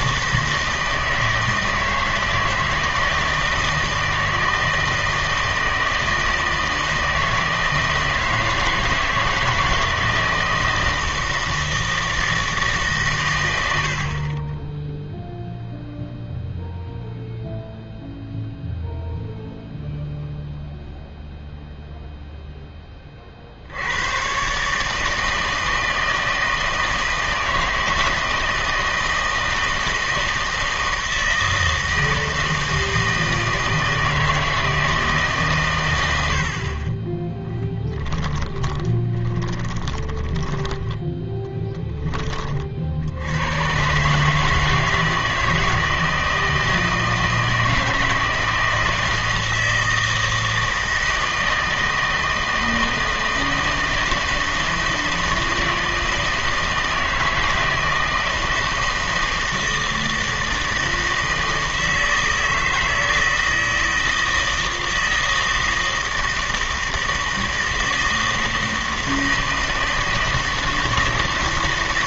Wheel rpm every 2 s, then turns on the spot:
160, 160, 160, 160, 160, 160, 150, 20, 0, 0, 0, 10, 140, 160, 160, 160, 160, 160, 40, 20, 10, 30, 150, 160, 160, 160, 160, 160, 160, 160, 160, 160, 160, 160, 160, 160.
38-42